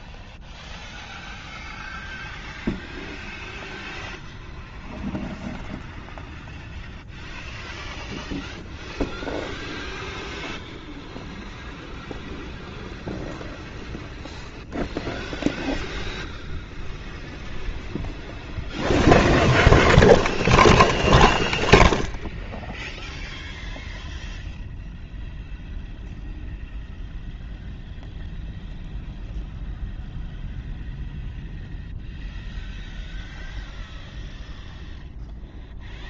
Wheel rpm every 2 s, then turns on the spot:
0, 0, 0, 0, 0, 0, 0, 0, 0, 0, 0, 0, 0, 0, 0, 0, 0, 0.
none